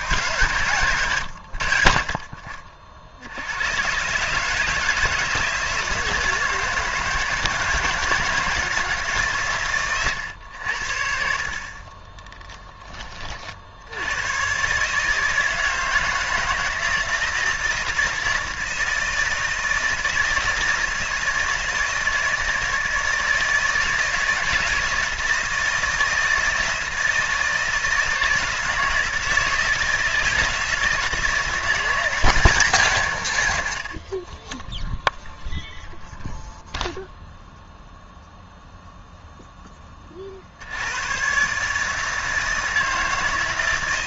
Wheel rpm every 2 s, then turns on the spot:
150, 50, 150, 170, 160, 90, 10, 130, 160, 160, 160, 160, 160, 160, 160, 170, 170, 10, 0, 0, 70, 160.
none